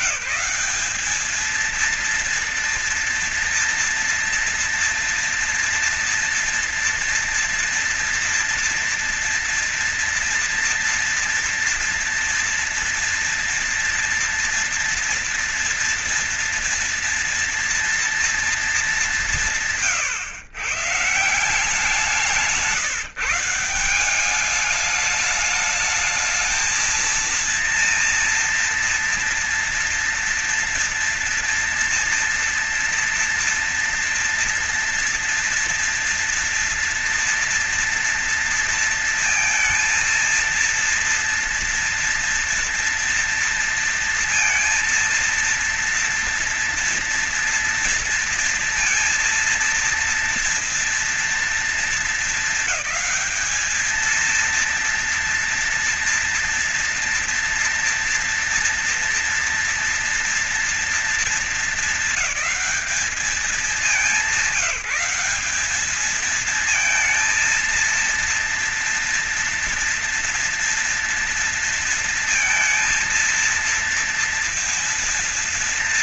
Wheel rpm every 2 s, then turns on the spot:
210, 230, 230, 230, 230, 230, 230, 230, 230, 200, 150, 170, 210, 220, 230, 230, 230, 230, 230, 230, 230, 230, 230, 230, 230, 230, 220, 230, 230, 240, 230, 210, 190, 230, 230, 230, 230, 230.
none